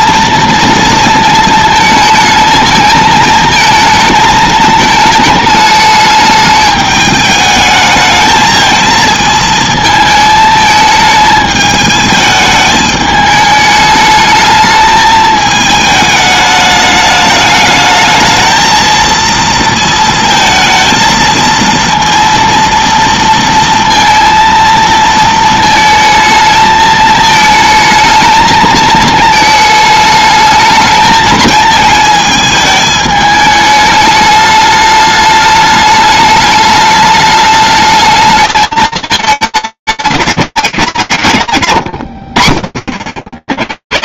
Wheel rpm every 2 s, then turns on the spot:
230, 220, 220, 210, 220, 220, 220, 220, 210, 220, 230, 230, 230, 220, 220, 220, 220, 210, 210, 210, 90, 70.
none